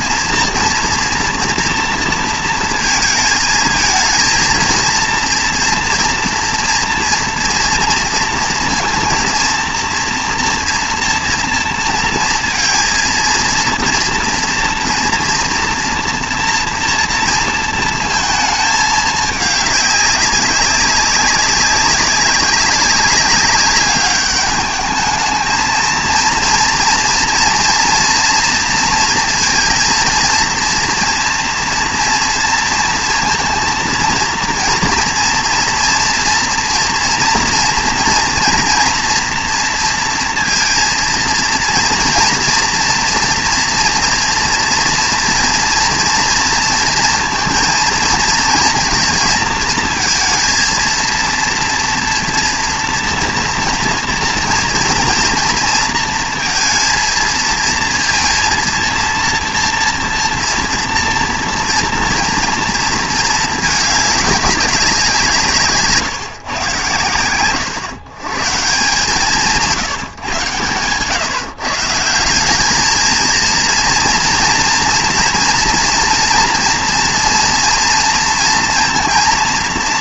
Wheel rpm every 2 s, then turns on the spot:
230, 230, 230, 230, 230, 230, 230, 230, 230, 220, 190, 190, 210, 230, 230, 230, 230, 230, 230, 230, 230, 230, 240, 230, 230, 230, 230, 230, 230, 230, 240, 230, 200, 130, 150, 130, 190, 240, 230, 230.
none